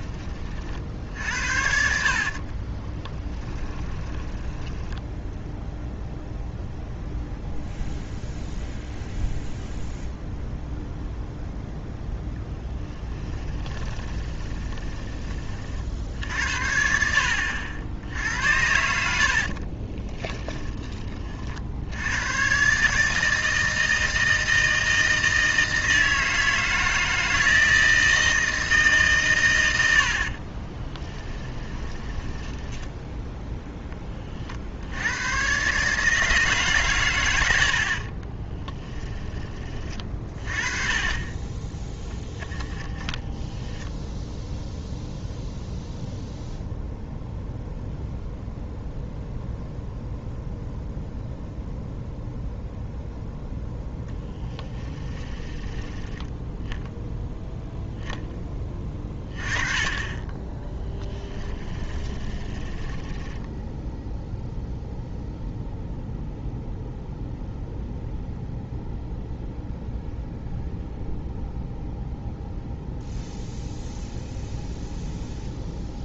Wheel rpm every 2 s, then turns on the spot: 40, 30, 10, 0, 0, 0, 10, 20, 70, 80, 20, 130, 160, 160, 160, 30, 20, 70, 130, 10, 30, 10, 0, 0, 0, 0, 0, 20, 0, 20, 20, 20, 0, 0, 0, 0, 0, 0.
2-6 12-16 30-34 38-40 42-44 54-56 60-64